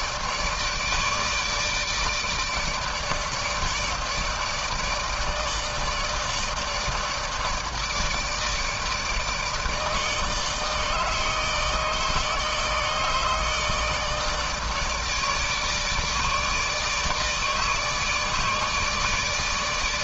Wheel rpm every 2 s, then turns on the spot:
150, 150, 150, 160, 160, 160, 150, 150, 150, 150.
none